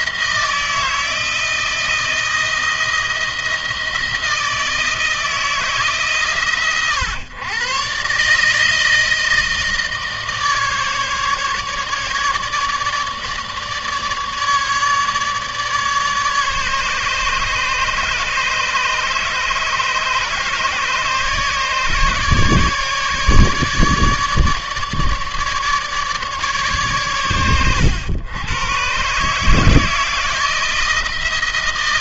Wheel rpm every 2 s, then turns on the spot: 170, 160, 160, 130, 160, 150, 150, 150, 150, 150, 150, 150, 150, 130, 120, 160.
none